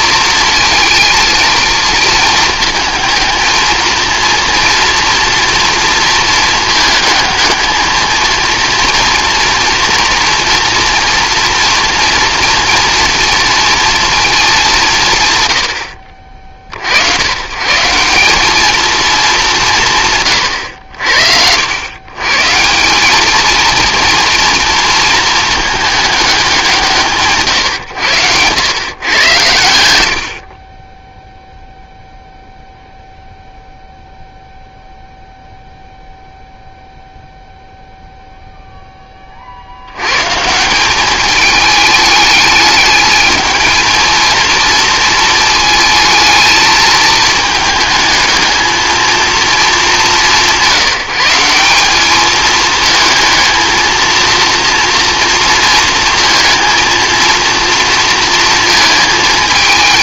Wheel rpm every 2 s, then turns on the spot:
220, 220, 230, 220, 230, 240, 240, 190, 60, 210, 100, 160, 230, 170, 110, 40, 0, 0, 0, 0, 170, 210, 220, 220, 220, 180, 220, 230, 230, 230.
none